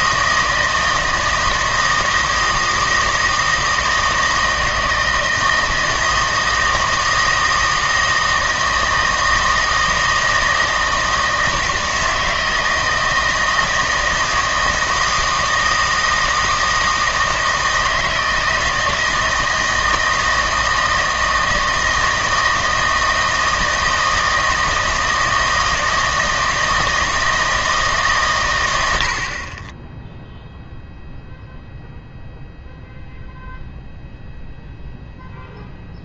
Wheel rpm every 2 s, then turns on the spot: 160, 160, 160, 160, 160, 160, 160, 160, 160, 160, 160, 160, 160, 160, 100, 0, 0, 0.
none